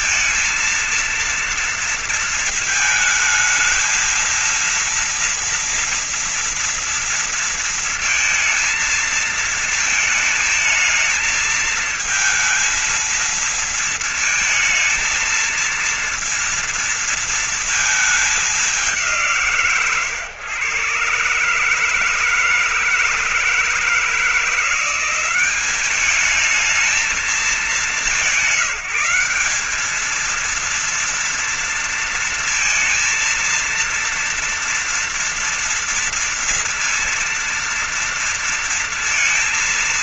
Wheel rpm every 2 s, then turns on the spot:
230, 230, 230, 230, 230, 220, 220, 220, 230, 220, 140, 160, 160, 200, 180, 200, 230, 230, 230, 230.
none